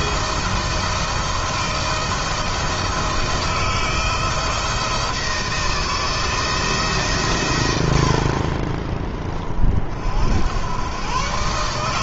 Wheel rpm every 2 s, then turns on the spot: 160, 160, 170, 160, 30, 100.
none